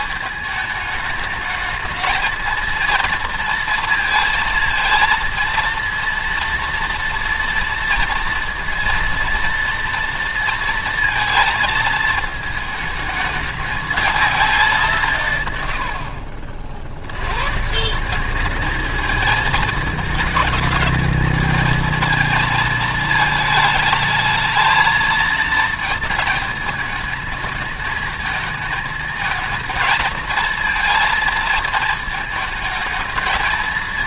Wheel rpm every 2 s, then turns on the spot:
210, 230, 230, 230, 230, 230, 220, 200, 60, 210, 220, 220, 230, 220, 220, 220, 220.
none